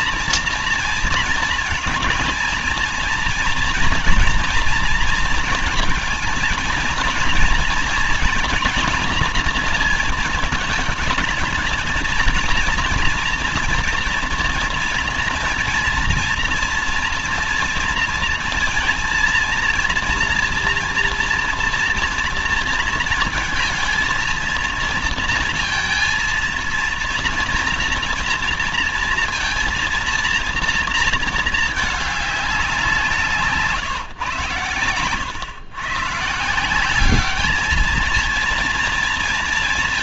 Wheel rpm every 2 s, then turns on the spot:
230, 230, 230, 230, 230, 230, 240, 240, 230, 230, 230, 230, 230, 230, 230, 230, 190, 120, 160, 230.
none